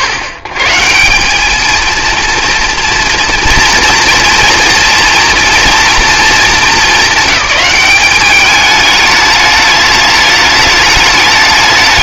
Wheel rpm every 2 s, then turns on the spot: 130, 230, 230, 200, 200, 210.
none